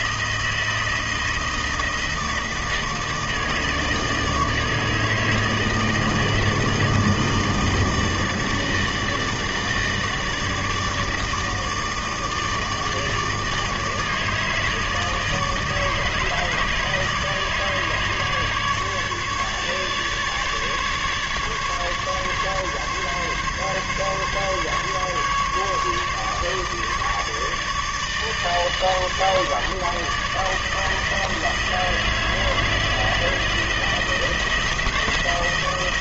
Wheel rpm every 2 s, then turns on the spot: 160, 160, 160, 160, 160, 160, 160, 160, 160, 150, 150, 140, 140, 150, 150, 160, 160, 160.
none